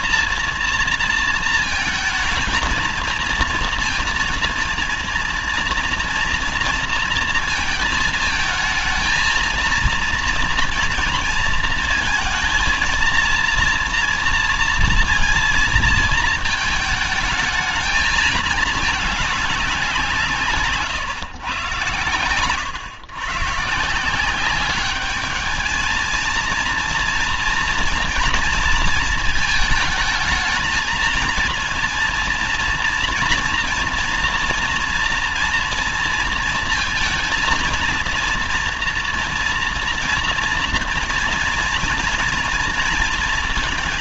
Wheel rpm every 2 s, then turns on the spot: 230, 220, 230, 230, 220, 230, 230, 230, 220, 210, 140, 120, 200, 230, 230, 220, 230, 230, 230, 240, 240, 230.
none